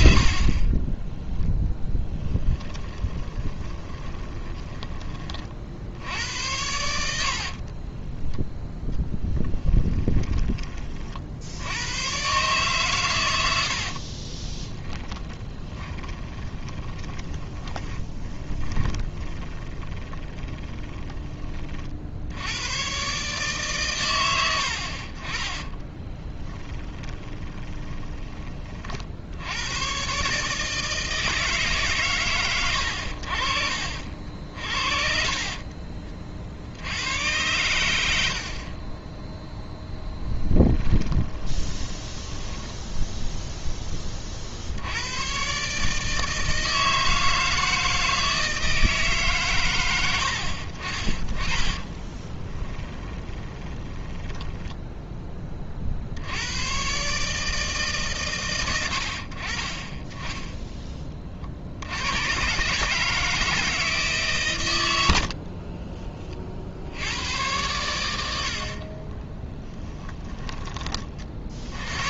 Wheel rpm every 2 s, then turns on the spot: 30, 20, 20, 90, 10, 30, 130, 10, 20, 20, 20, 100, 80, 10, 40, 150, 100, 50, 70, 30, 10, 10, 70, 160, 160, 50, 20, 20, 110, 90, 10, 150, 110, 50, 50, 20.
0-6 14-22 26-28 34-36 40-44 52-56